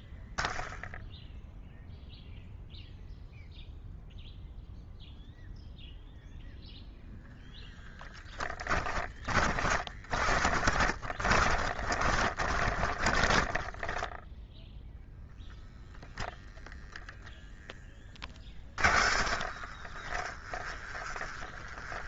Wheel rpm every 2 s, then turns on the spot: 0, 0, 0, 0, 30, 40, 20, 0, 0, 40, 30.
8-14 18-22